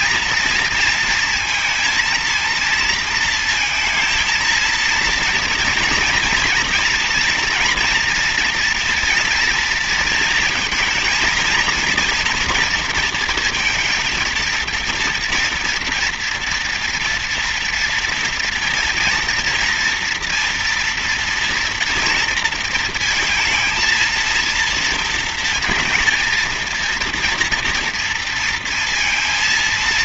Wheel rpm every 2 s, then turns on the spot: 230, 230, 230, 230, 230, 220, 230, 230, 230, 230, 230, 230, 230, 230, 230.
none